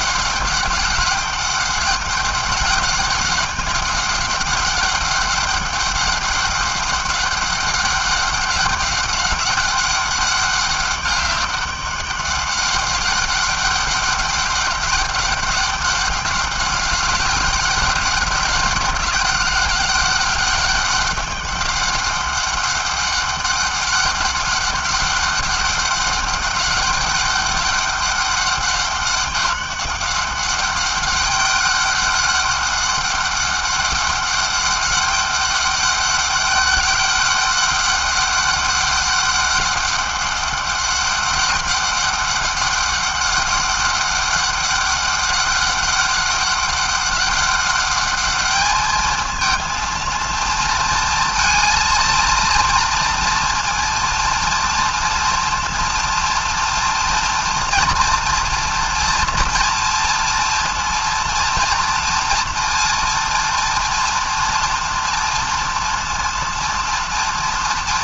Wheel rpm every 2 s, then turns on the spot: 200, 200, 200, 200, 200, 200, 190, 200, 200, 200, 200, 200, 200, 200, 200, 200, 200, 200, 200, 200, 200, 200, 200, 200, 210, 230, 230, 230, 230, 230, 230, 230, 240, 230.
none